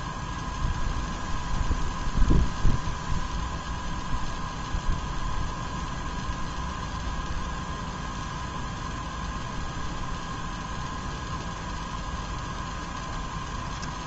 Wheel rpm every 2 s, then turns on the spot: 0, 0, 0, 0, 0, 0, 10.
none